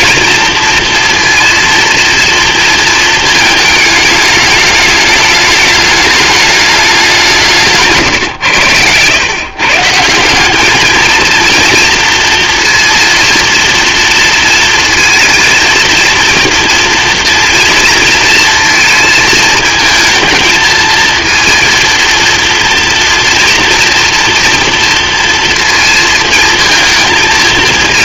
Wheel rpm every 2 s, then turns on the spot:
230, 230, 210, 210, 100, 210, 230, 230, 230, 230, 230, 230, 230, 230.
none